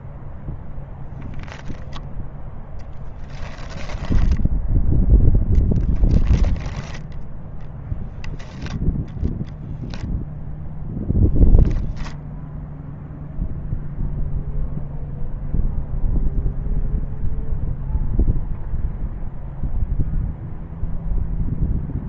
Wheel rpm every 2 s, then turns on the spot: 0, 10, 0, 10, 0, 0, 0, 0, 0, 0, 0.
2-4